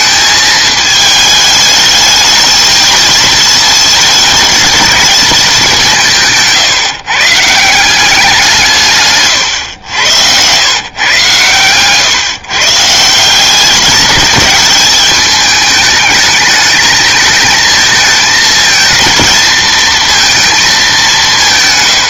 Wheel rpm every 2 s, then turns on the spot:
220, 220, 220, 140, 150, 130, 160, 210, 220, 220, 200.
none